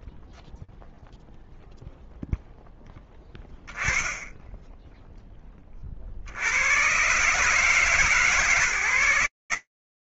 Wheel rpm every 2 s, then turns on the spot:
0, 10, 10, 100, 130.
none